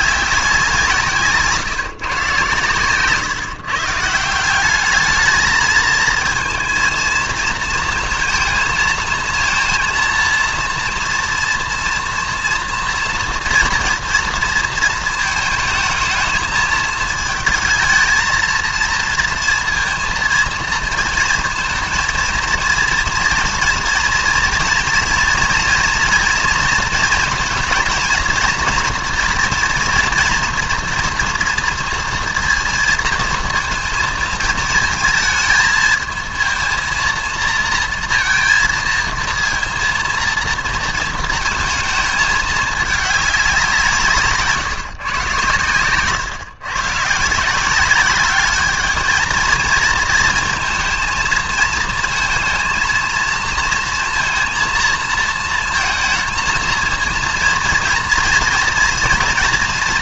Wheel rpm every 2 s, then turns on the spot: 180, 120, 190, 230, 230, 230, 230, 230, 220, 230, 230, 230, 230, 230, 230, 230, 230, 220, 230, 230, 230, 210, 140, 120, 210, 230, 220, 230, 230, 230.
none